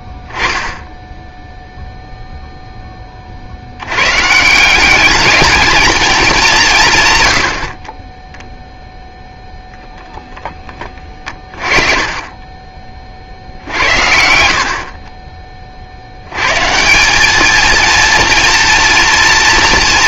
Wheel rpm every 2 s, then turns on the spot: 0, 0, 170, 180, 0, 10, 30, 60, 130, 230.
none